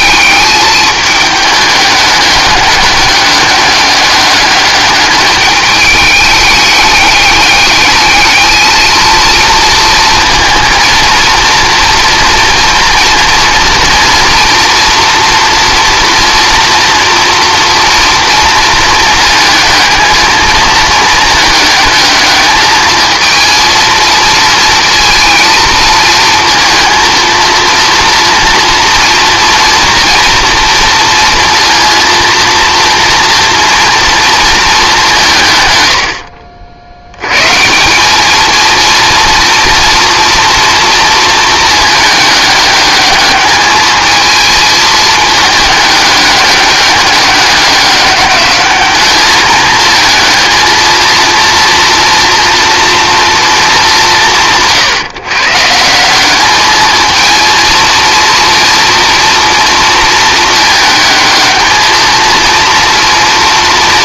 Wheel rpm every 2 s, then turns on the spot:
210, 200, 210, 210, 220, 230, 230, 230, 240, 230, 220, 220, 230, 230, 240, 230, 230, 220, 70, 230, 230, 210, 220, 200, 200, 230, 240, 150, 210, 230, 220, 230.
none